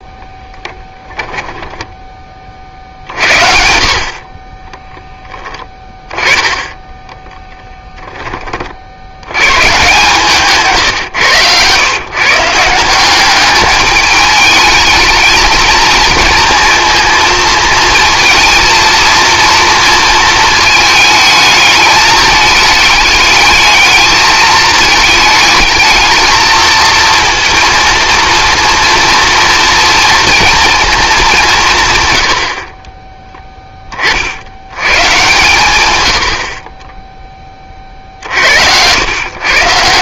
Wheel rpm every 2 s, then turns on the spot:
10, 50, 10, 10, 60, 140, 180, 210, 230, 230, 220, 210, 220, 230, 230, 230, 30, 110, 20, 100.
4-6